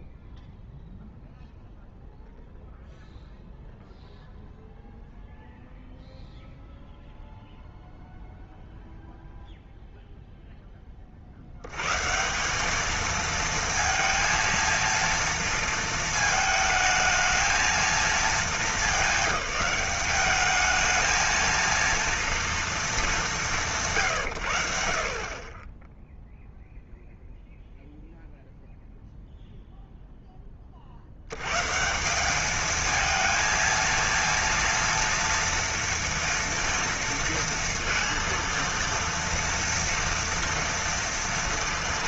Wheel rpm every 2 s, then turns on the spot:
0, 0, 0, 0, 0, 10, 200, 230, 220, 210, 210, 230, 90, 0, 0, 30, 210, 230, 230, 230, 230.
none